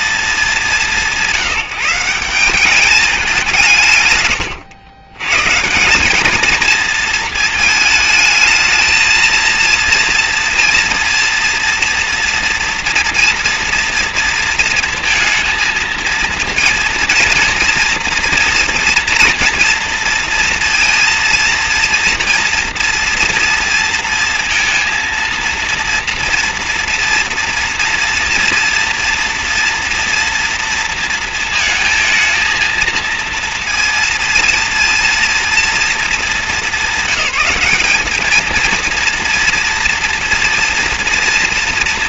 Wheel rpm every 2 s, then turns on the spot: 200, 190, 110, 220, 220, 230, 240, 230, 230, 240, 230, 230, 230, 230, 230, 230, 230, 230, 210, 230, 230.
none